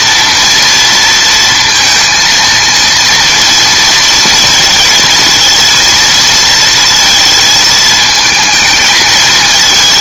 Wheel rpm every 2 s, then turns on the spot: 230, 230, 220, 230, 220.
none